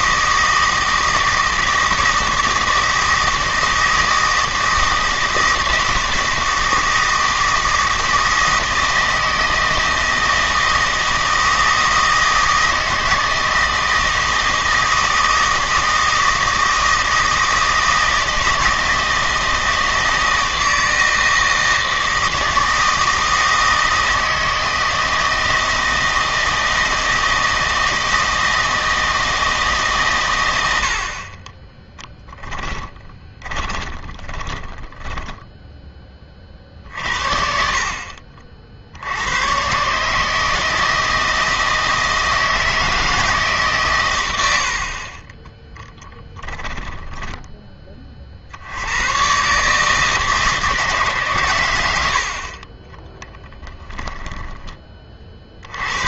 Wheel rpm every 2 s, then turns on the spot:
160, 160, 160, 160, 160, 160, 160, 160, 160, 160, 160, 160, 160, 160, 160, 70, 10, 10, 60, 50, 160, 160, 70, 10, 80, 150, 30, 20.
32-36 46-48